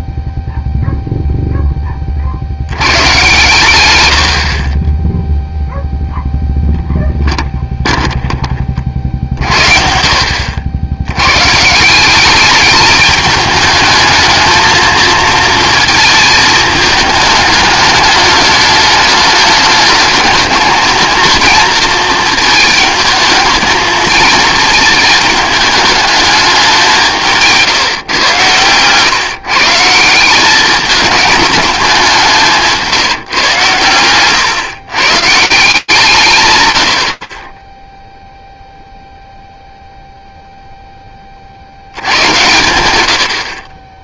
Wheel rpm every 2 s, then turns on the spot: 0, 70, 50, 0, 30, 80, 210, 220, 210, 210, 220, 220, 220, 210, 110, 190, 180, 120, 110, 0, 10, 100.
none